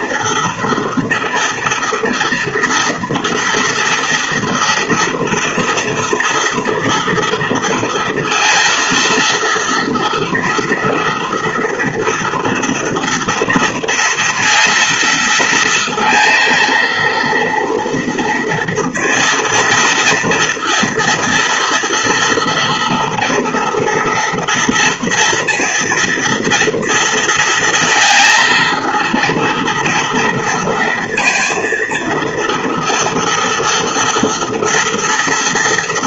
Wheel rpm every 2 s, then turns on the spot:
230, 230, 230, 230, 230, 240, 230, 230, 230, 230, 230, 230, 230, 230, 230, 230, 230, 240.
none